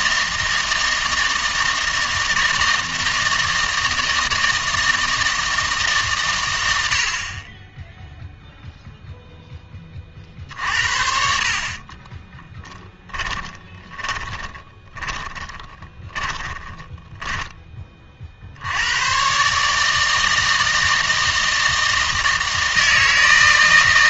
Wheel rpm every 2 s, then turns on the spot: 160, 160, 160, 80, 0, 70, 10, 20, 10, 90, 160, 160.
12-18